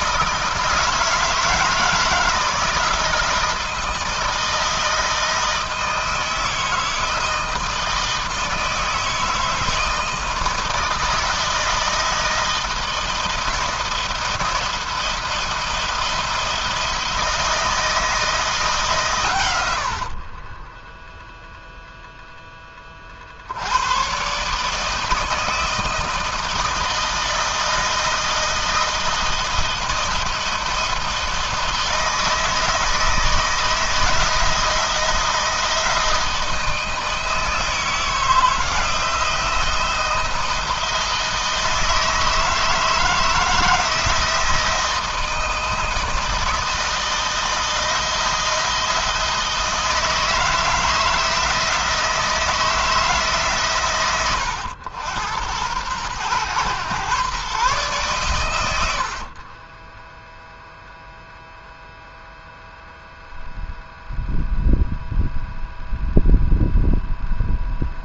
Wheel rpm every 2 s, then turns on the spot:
160, 160, 160, 160, 160, 160, 160, 170, 160, 140, 10, 30, 150, 160, 160, 170, 160, 160, 160, 170, 160, 160, 160, 160, 160, 160, 160, 90, 120, 80, 0, 0, 0, 0.
20-22